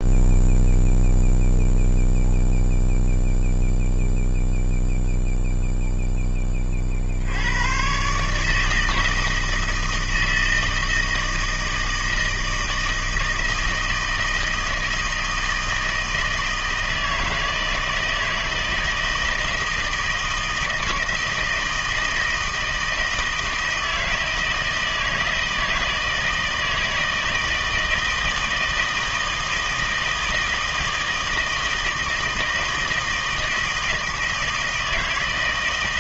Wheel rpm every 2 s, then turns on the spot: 0, 0, 0, 30, 160, 160, 160, 160, 160, 160, 170, 160, 160, 160, 160, 160, 160, 160.
none